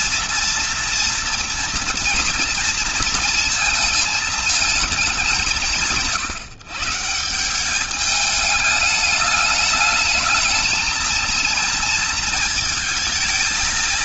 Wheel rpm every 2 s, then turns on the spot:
230, 230, 180, 180, 210, 230, 220.
none